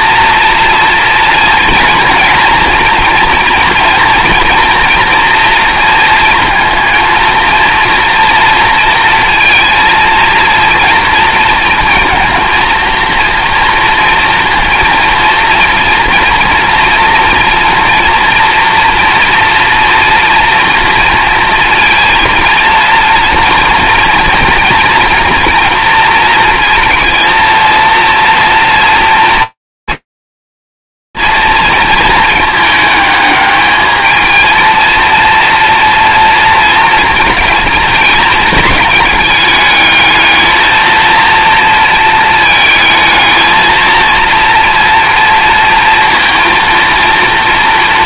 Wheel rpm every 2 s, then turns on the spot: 230, 230, 240, 230, 230, 230, 230, 230, 230, 230, 230, 230, 230, 230, 230, 220, 220, 230, 220, 210, 220, 230, 230, 230.
none